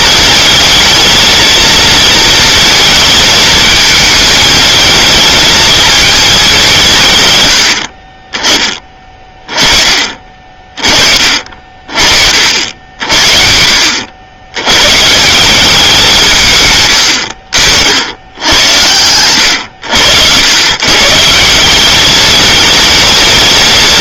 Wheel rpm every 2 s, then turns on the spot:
220, 220, 220, 160, 20, 30, 60, 130, 100, 90, 140, 220.
none